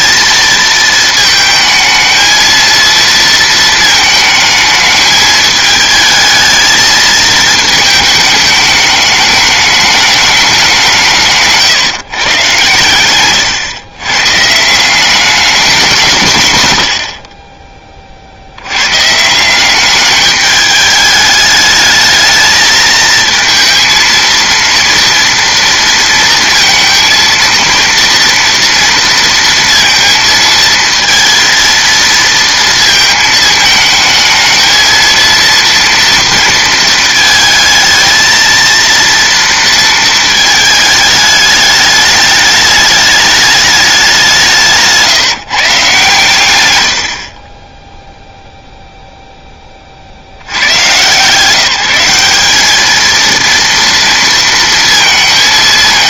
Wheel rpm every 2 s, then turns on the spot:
220, 230, 220, 220, 210, 190, 130, 160, 110, 90, 210, 220, 230, 230, 230, 230, 230, 220, 230, 230, 220, 210, 160, 110, 0, 110, 210, 230.
44-46